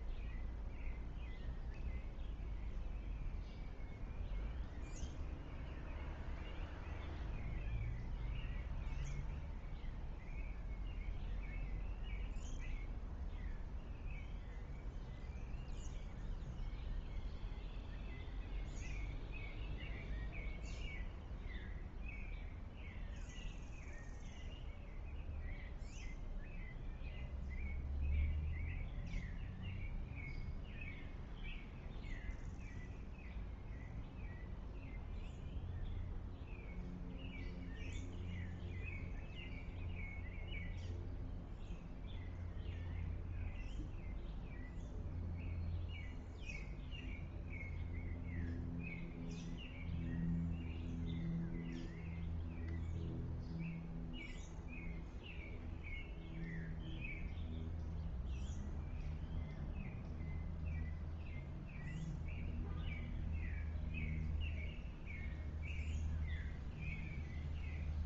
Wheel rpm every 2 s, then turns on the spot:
0, 0, 0, 0, 0, 0, 0, 0, 0, 0, 0, 0, 0, 0, 0, 0, 0, 0, 0, 0, 0, 0, 0, 0, 0, 0, 0, 0, 0, 0, 0, 0, 0, 0.
none